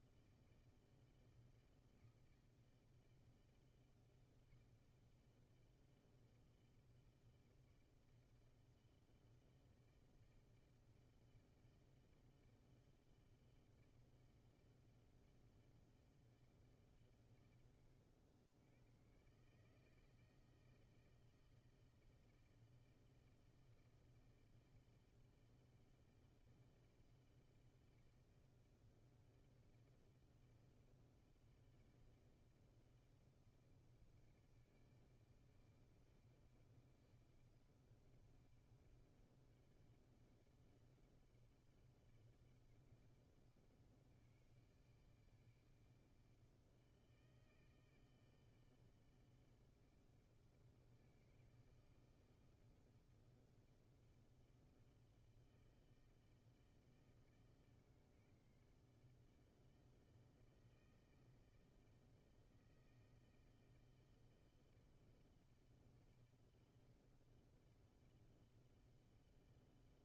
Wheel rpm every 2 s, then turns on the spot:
160, 160, 160, 160, 160, 160, 160, 160, 150, 100, 160, 160, 160, 160, 160, 160, 160, 160, 160, 160, 160, 160, 160, 160, 160, 160, 160, 160, 160, 150, 160, 160, 160, 160, 160.
none